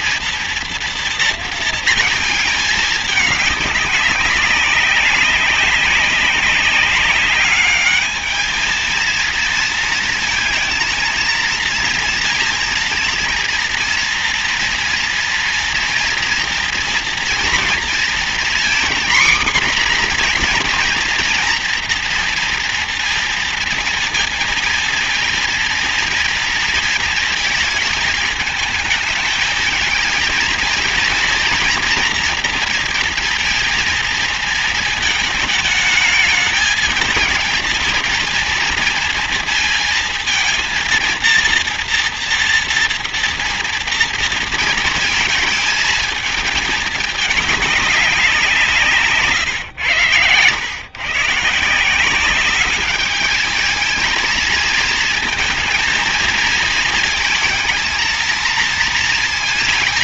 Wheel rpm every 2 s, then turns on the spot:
230, 220, 200, 200, 220, 230, 230, 230, 230, 230, 250, 240, 230, 230, 220, 220, 230, 230, 220, 230, 230, 230, 230, 220, 190, 110, 190, 220, 220, 230.
none